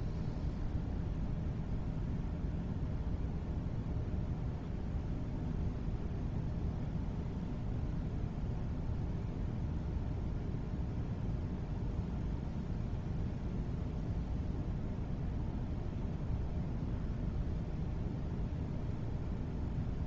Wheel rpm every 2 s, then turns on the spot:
0, 0, 0, 0, 0, 0, 0, 0, 0, 0.
none